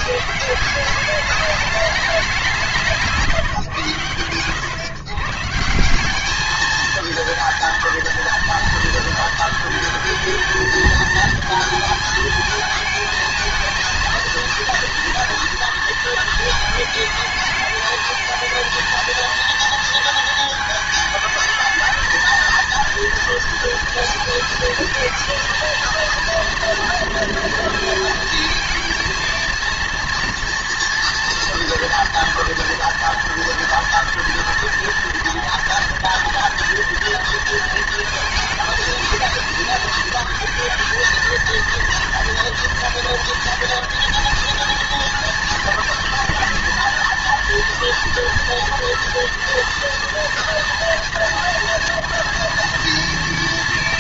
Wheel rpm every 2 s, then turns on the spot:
180, 170, 120, 220, 230, 220, 220, 230, 220, 230, 220, 230, 220, 230, 230, 230, 230, 230, 230, 220, 220, 230, 230, 230, 230, 230, 240.
none